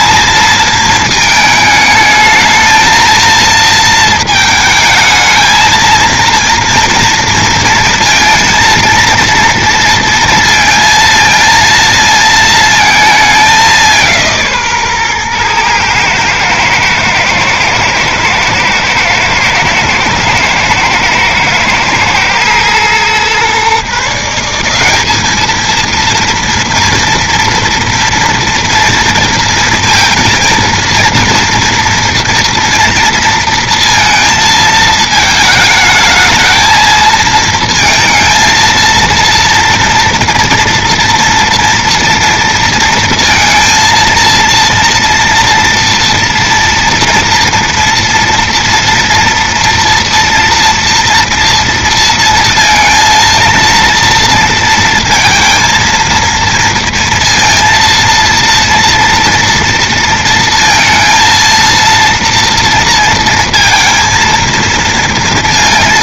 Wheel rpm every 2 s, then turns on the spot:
230, 220, 220, 230, 230, 230, 230, 180, 110, 110, 120, 110, 150, 230, 230, 230, 230, 230, 220, 220, 230, 230, 230, 230, 230, 230, 230, 230, 230, 230, 230, 230, 230.
none